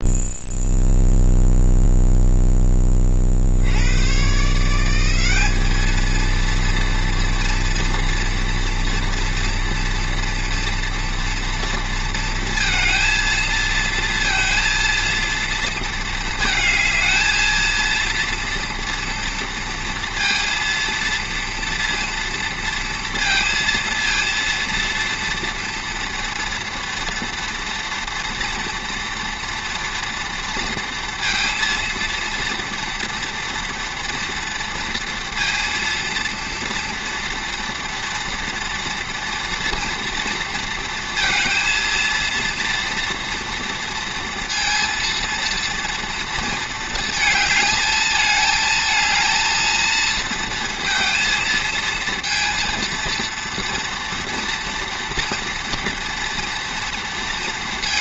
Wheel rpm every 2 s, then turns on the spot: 0, 10, 160, 230, 230, 230, 230, 230, 220, 230, 230, 230, 230, 230, 240, 230, 230, 230, 230, 230, 230, 230, 230, 220, 220, 230, 230, 230, 230.
none